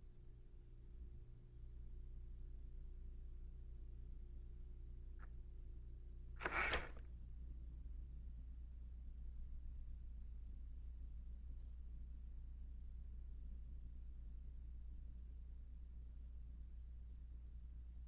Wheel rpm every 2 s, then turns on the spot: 0, 0, 0, 0, 0, 0, 0, 0, 0.
none